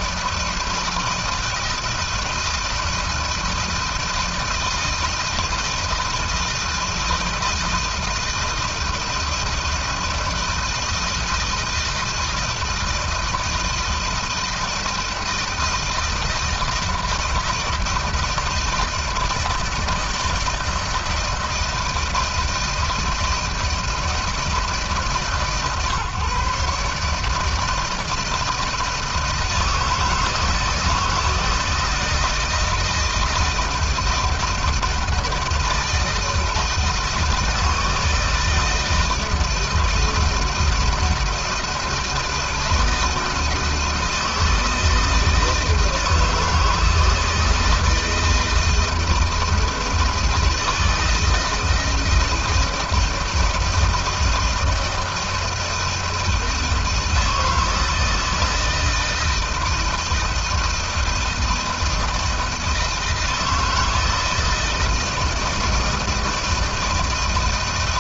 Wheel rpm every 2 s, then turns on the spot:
160, 160, 160, 160, 160, 160, 160, 160, 160, 160, 160, 160, 150, 150, 160, 160, 170, 160, 160, 160, 160, 160, 160, 160, 160, 160, 160, 160, 160, 160, 160, 160, 160, 160.
none